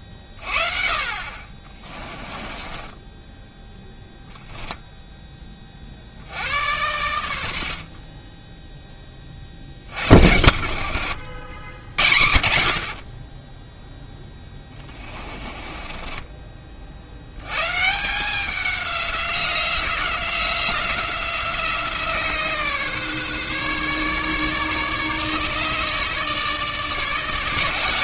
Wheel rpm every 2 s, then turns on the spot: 30, 20, 0, 80, 10, 70, 60, 20, 40, 190, 180, 150, 150, 150.
2-4 14-16